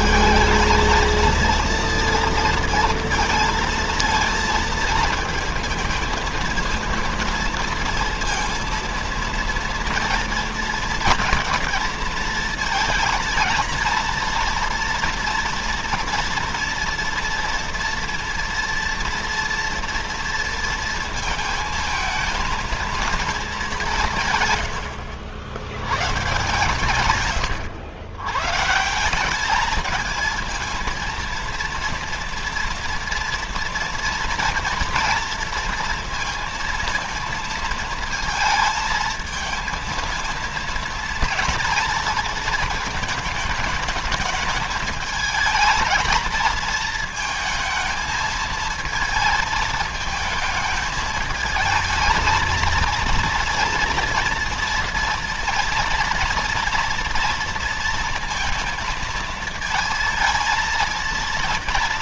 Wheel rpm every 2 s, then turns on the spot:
220, 230, 220, 230, 230, 230, 220, 230, 230, 230, 230, 220, 90, 130, 160, 230, 230, 230, 230, 220, 230, 210, 220, 220, 220, 220, 230, 230, 230, 230, 230.
none